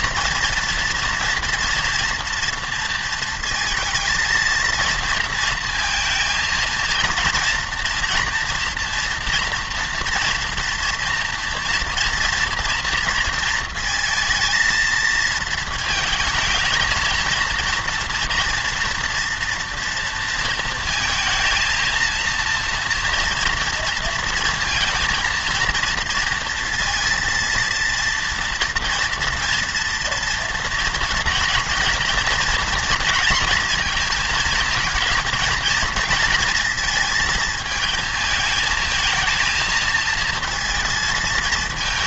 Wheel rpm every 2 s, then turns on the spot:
230, 230, 230, 230, 230, 230, 230, 230, 220, 230, 230, 230, 230, 230, 230, 230, 240, 220, 230, 220, 220.
none